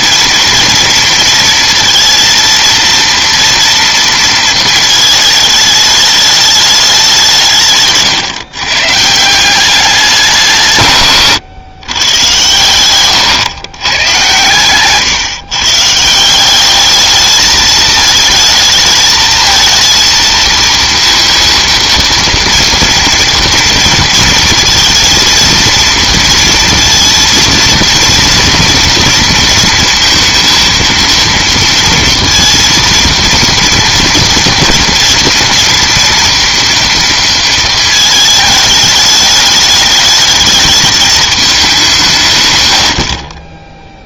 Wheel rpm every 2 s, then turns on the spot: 230, 230, 220, 210, 140, 150, 120, 120, 190, 220, 230, 230, 230, 230, 230, 230, 230, 230, 230, 210, 210, 110.
12-16